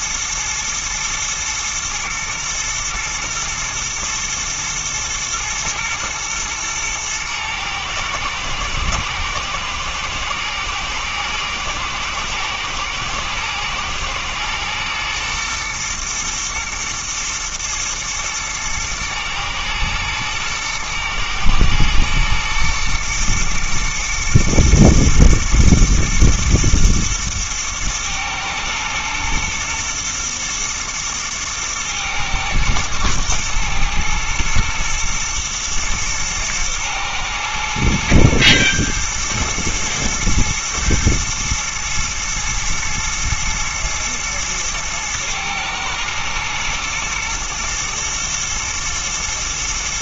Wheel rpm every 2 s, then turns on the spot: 120, 120, 110, 110, 110, 110, 110, 120, 110, 110, 110, 120, 110, 110, 110, 110, 110, 110, 110, 110, 120, 110, 110, 120, 120.
none